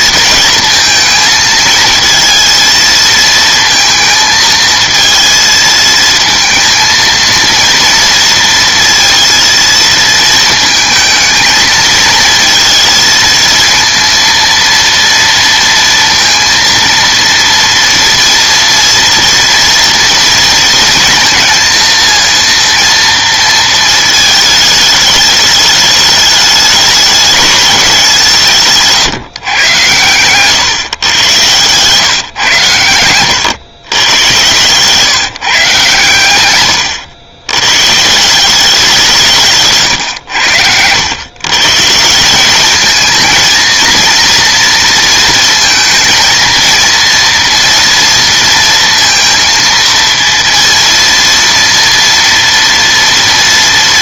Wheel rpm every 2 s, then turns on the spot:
230, 220, 230, 230, 230, 220, 230, 230, 230, 230, 230, 230, 210, 200, 150, 130, 120, 120, 110, 180, 90, 200, 230, 230, 230, 230, 230.
none